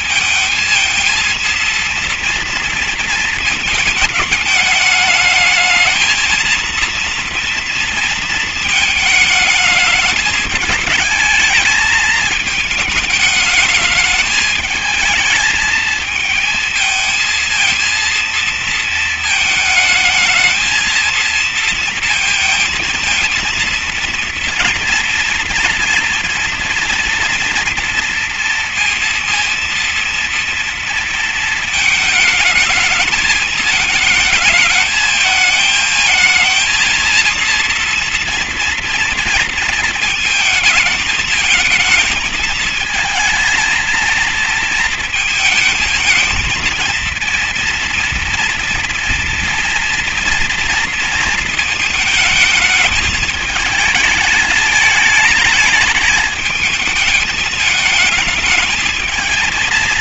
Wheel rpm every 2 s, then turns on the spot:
220, 230, 220, 230, 220, 210, 220, 220, 230, 220, 220, 230, 230, 230, 230, 230, 220, 220, 230, 230, 220, 220, 230, 230, 230, 230, 220, 220, 220, 220.
none